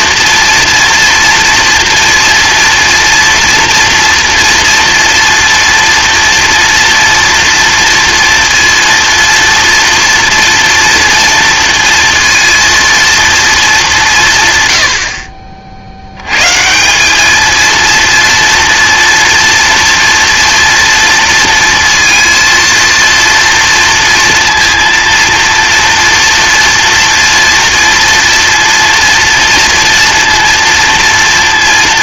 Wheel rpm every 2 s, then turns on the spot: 230, 230, 230, 230, 230, 230, 230, 120, 160, 230, 230, 230, 230, 230, 230, 230.
none